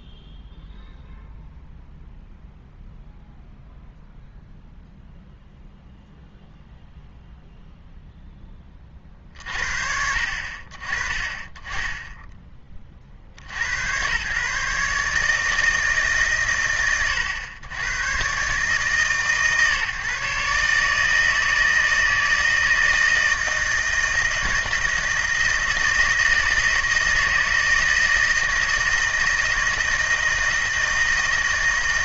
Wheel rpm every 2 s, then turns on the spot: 0, 0, 0, 0, 10, 50, 30, 140, 110, 140, 150, 160, 160, 160, 160, 160.
none